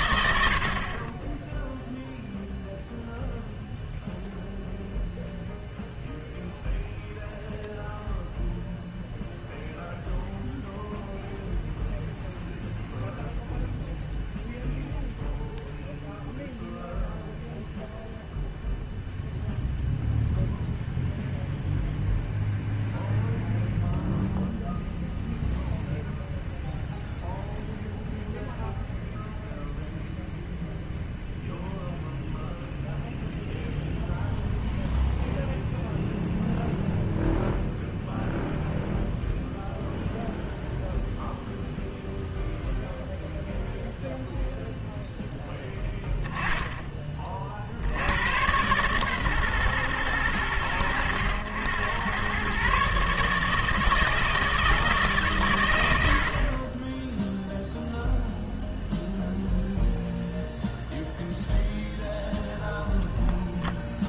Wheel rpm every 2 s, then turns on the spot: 50, 0, 0, 0, 0, 0, 0, 0, 0, 0, 0, 0, 0, 0, 0, 0, 0, 0, 0, 0, 0, 0, 0, 10, 130, 100, 130, 160, 30, 0, 0, 0.
none